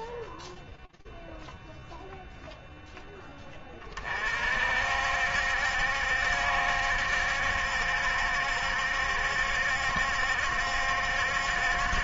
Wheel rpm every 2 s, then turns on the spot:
0, 0, 60, 70, 70, 70.
none